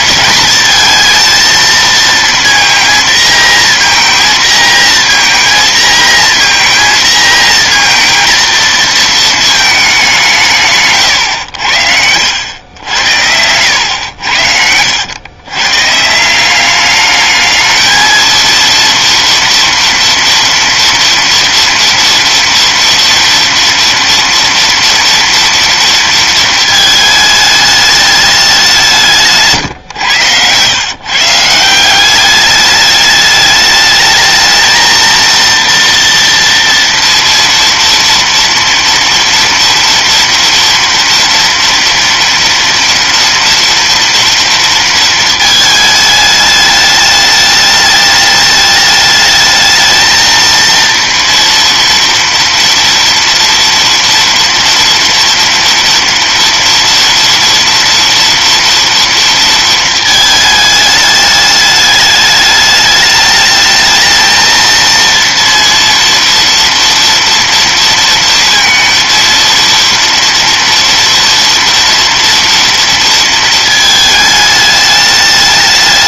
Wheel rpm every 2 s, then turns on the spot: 230, 230, 230, 230, 230, 120, 80, 100, 210, 230, 230, 230, 240, 220, 160, 140, 210, 230, 230, 230, 230, 230, 230, 210, 210, 230, 230, 230, 230, 230, 210, 210, 230, 230, 230, 230, 230, 210.
12-14